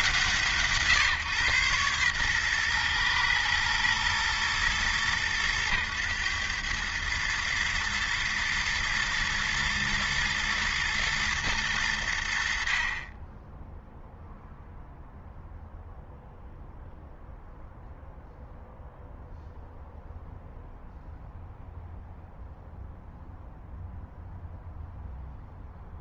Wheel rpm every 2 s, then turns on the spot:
150, 120, 110, 110, 110, 110, 40, 0, 0, 0, 0, 0, 0.
none